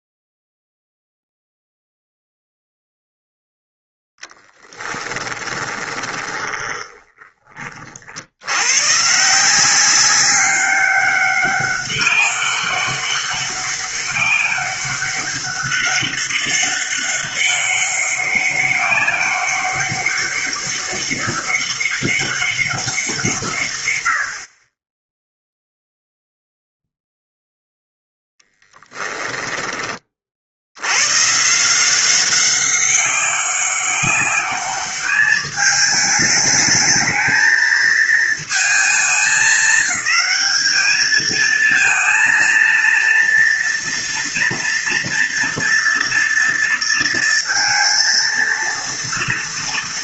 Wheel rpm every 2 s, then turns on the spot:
0, 0, 10, 20, 120, 190, 200, 200, 200, 200, 200, 190, 20, 0, 10, 80, 190, 210, 220, 210, 210, 230, 230, 230, 230.
4-8 28-30